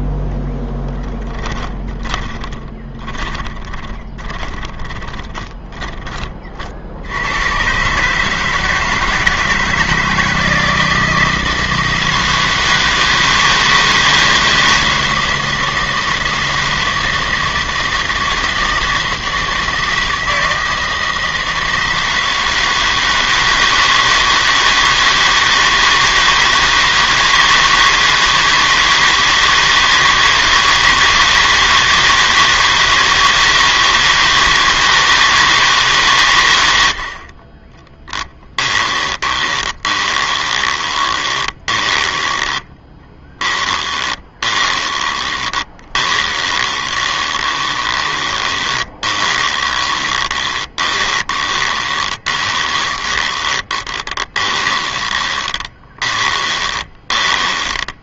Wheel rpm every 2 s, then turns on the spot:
10, 20, 20, 40, 160, 160, 160, 160, 160, 160, 160, 160, 160, 160, 160, 160, 160, 160, 80, 20, 20, 10, 20, 20, 20, 20, 20, 20, 20.
2-6 38-58